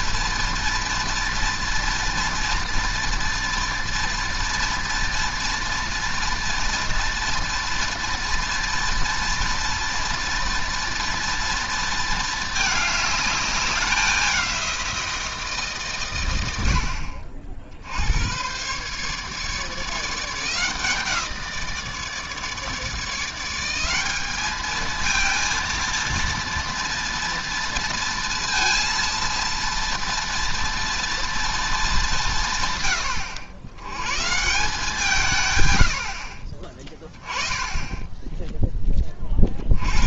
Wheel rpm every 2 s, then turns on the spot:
230, 230, 230, 230, 230, 230, 210, 180, 70, 130, 170, 150, 220, 230, 230, 240, 120, 180, 30, 10.
none